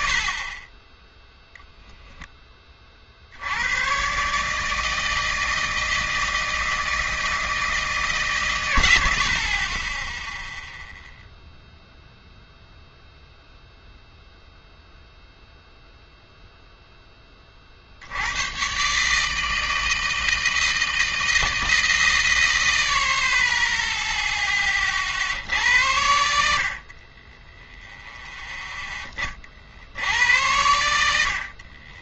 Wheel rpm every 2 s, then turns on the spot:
30, 20, 160, 160, 120, 0, 0, 0, 0, 130, 160, 80, 20, 60, 10, 90.
none